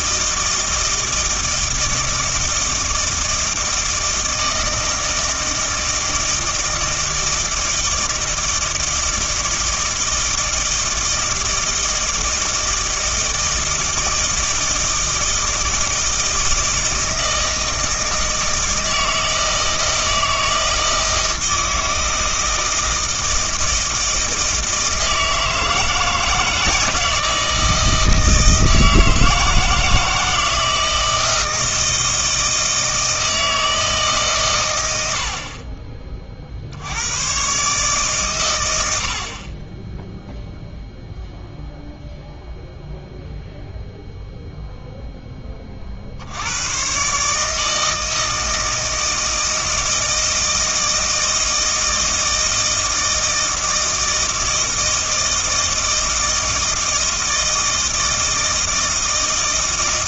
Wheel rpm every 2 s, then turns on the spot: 160, 160, 160, 160, 160, 160, 160, 160, 160, 160, 160, 160, 160, 160, 160, 160, 160, 100, 70, 90, 0, 0, 0, 110, 160, 160, 160, 160, 160, 160.
none